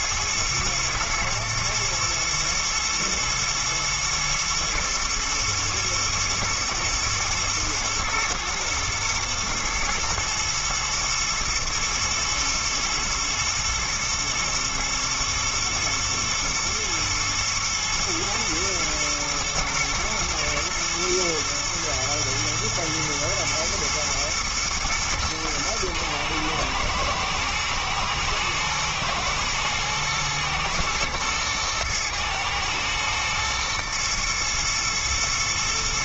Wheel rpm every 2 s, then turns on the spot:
110, 120, 110, 110, 110, 120, 120, 120, 120, 110, 110, 120, 120, 110, 110, 110, 110, 120.
none